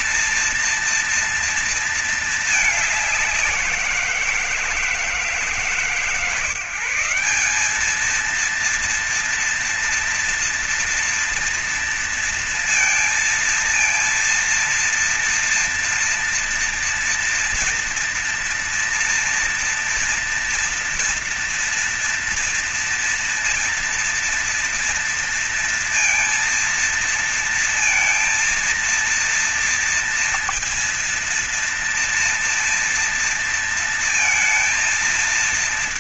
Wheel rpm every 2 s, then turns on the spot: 230, 210, 170, 170, 230, 230, 230, 230, 230, 230, 230, 230, 230, 230, 230, 230, 230, 230.
none